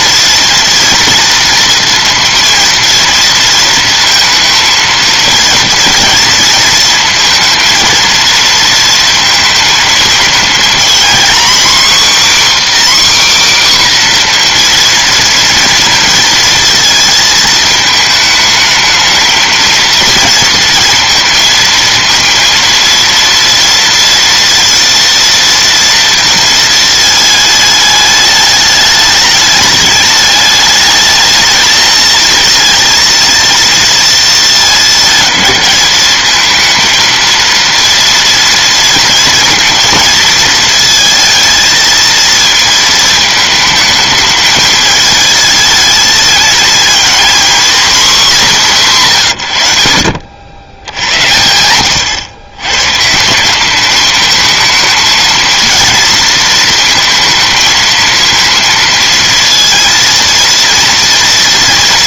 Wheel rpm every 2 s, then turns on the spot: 230, 230, 230, 230, 230, 240, 280, 240, 230, 220, 230, 230, 230, 220, 210, 220, 230, 220, 220, 230, 220, 220, 220, 230, 160, 90, 140, 220, 230, 230, 230.
none